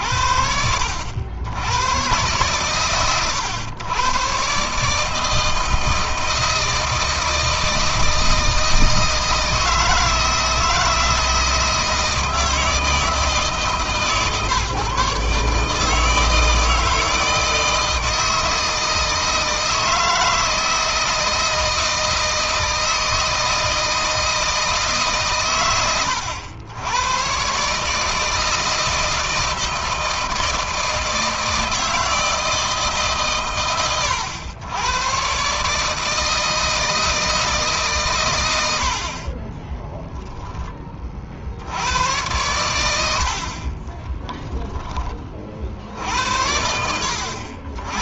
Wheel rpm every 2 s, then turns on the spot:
70, 130, 150, 160, 160, 160, 160, 150, 160, 160, 160, 160, 150, 110, 160, 160, 150, 120, 160, 60, 30, 90, 20, 80.
42-44